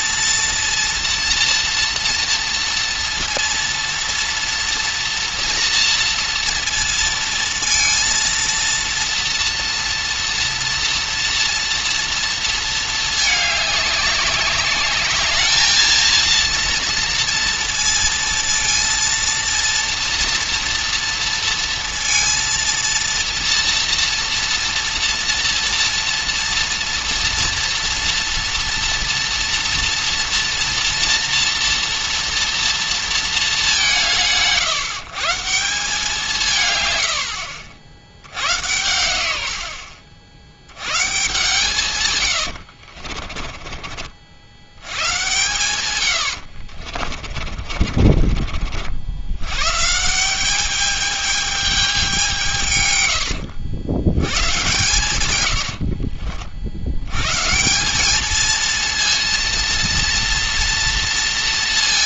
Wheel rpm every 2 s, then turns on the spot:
230, 230, 230, 230, 230, 230, 230, 210, 230, 230, 240, 230, 240, 230, 230, 230, 230, 160, 140, 100, 90, 80, 90, 60, 50, 200, 130, 120, 70, 220, 230.
42-44 46-48